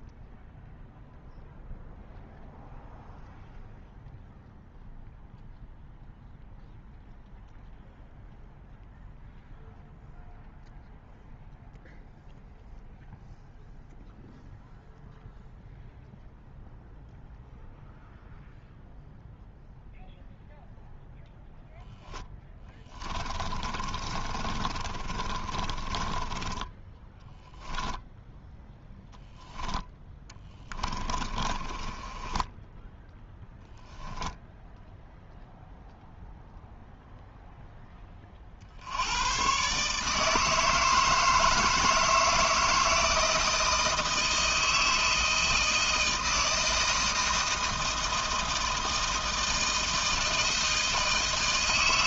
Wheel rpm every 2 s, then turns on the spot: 0, 0, 0, 0, 0, 0, 0, 0, 0, 0, 0, 10, 30, 20, 0, 20, 10, 0, 0, 60, 160, 160, 160, 160, 160, 160.
22-28 30-34